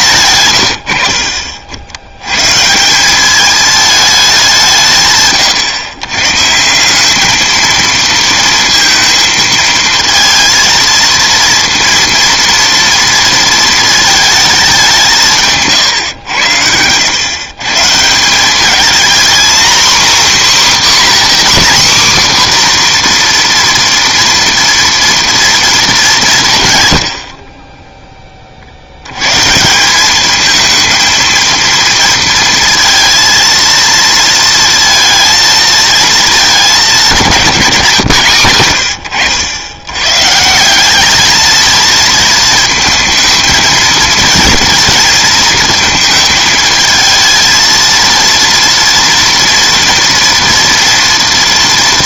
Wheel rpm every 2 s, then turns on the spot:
100, 130, 180, 160, 230, 230, 230, 210, 100, 200, 280, 260, 240, 150, 40, 220, 230, 230, 220, 120, 180, 230, 230, 220, 230, 230.
none